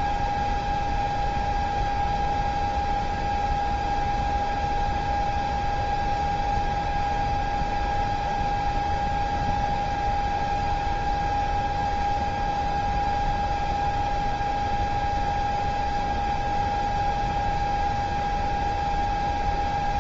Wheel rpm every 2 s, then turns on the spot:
0, 0, 0, 0, 0, 0, 0, 0, 0, 0.
none